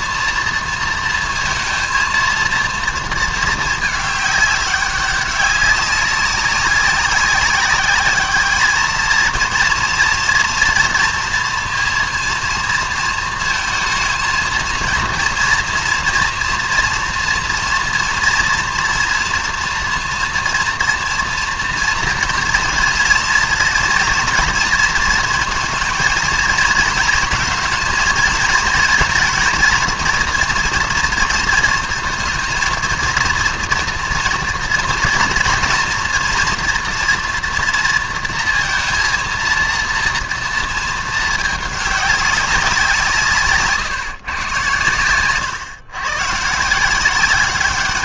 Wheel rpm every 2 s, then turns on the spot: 230, 230, 210, 200, 210, 240, 230, 230, 230, 230, 240, 230, 220, 230, 230, 230, 230, 230, 230, 230, 230, 200, 140, 120.
none